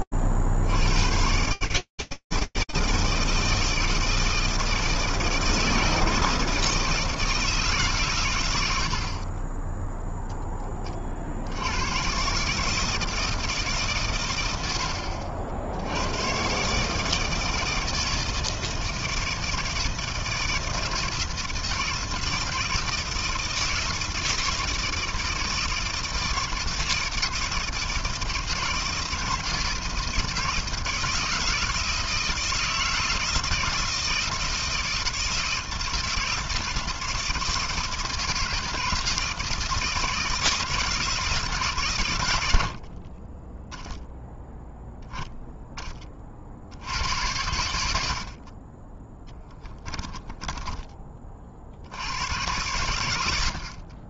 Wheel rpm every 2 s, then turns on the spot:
60, 160, 160, 160, 50, 50, 160, 60, 160, 160, 160, 160, 160, 160, 160, 170, 160, 160, 160, 160, 150, 20, 0, 100, 10, 30, 80.
48-50